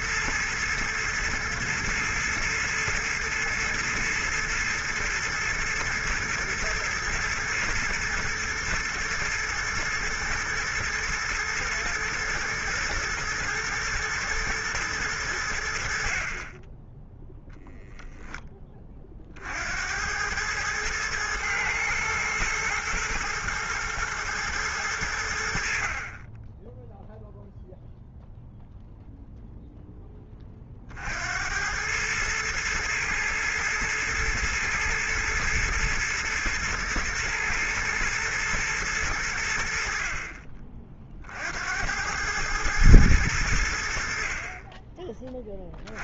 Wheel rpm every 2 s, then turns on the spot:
110, 110, 120, 120, 110, 110, 110, 110, 10, 20, 110, 110, 100, 10, 0, 50, 110, 110, 110, 110, 40, 110, 20.
none